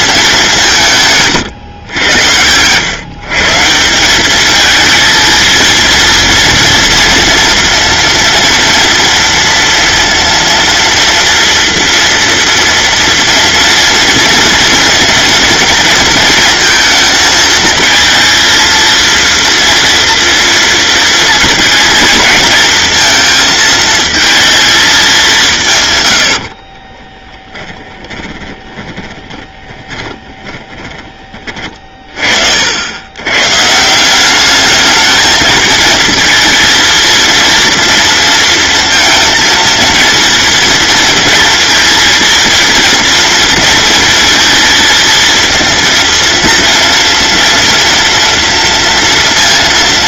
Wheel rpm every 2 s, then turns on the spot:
170, 130, 230, 230, 230, 230, 230, 230, 230, 230, 230, 220, 220, 30, 20, 20, 90, 210, 230, 230, 230, 230, 230, 230, 230.
26-32